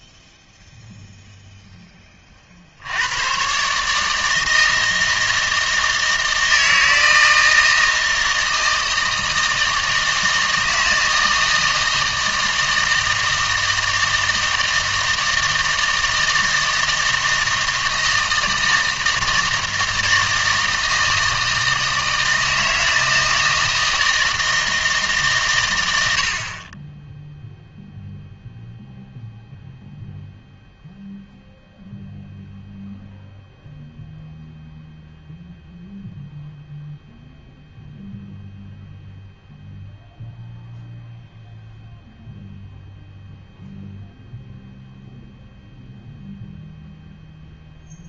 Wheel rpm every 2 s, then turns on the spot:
0, 80, 160, 160, 160, 160, 160, 160, 160, 160, 160, 160, 160, 30, 0, 0, 0, 0, 0, 0, 0, 0, 0, 0.
none